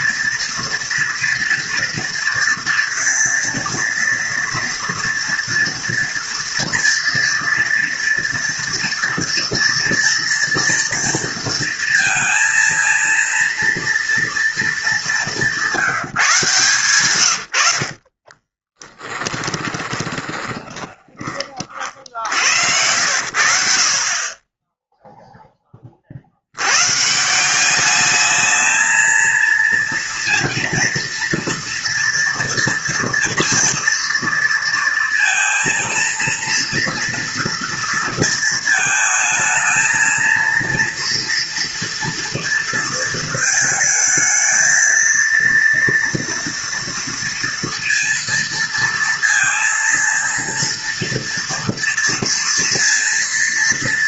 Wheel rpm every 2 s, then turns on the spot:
230, 230, 230, 230, 230, 230, 230, 220, 150, 20, 20, 80, 10, 100, 220, 230, 230, 230, 230, 220, 230, 230, 230, 230, 230, 230, 230.
18-22